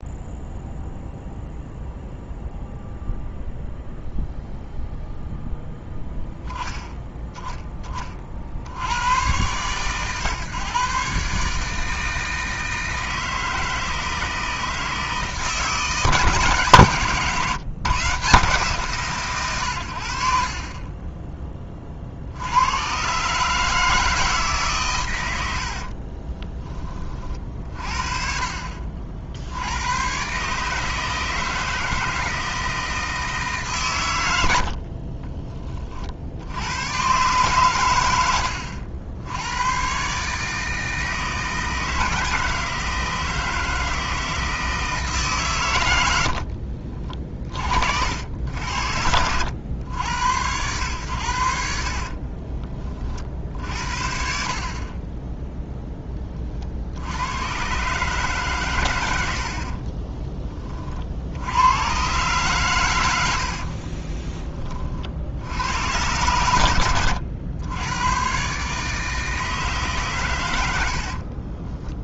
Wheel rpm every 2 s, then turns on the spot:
0, 0, 0, 10, 90, 140, 160, 160, 140, 140, 20, 120, 120, 30, 60, 160, 160, 50, 110, 70, 160, 160, 160, 40, 70, 100, 40, 20, 60, 110, 50, 100, 50, 90, 150, 70.
20-22 34-36 46-48 70-72